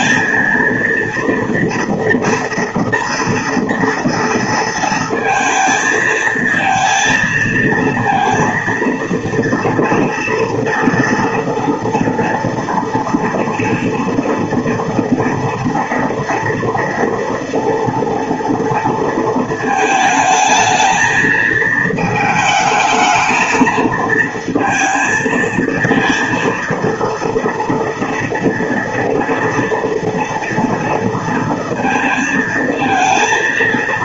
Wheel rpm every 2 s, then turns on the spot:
230, 230, 230, 220, 230, 230, 230, 230, 240, 230, 220, 220, 230, 230, 230, 230, 230.
none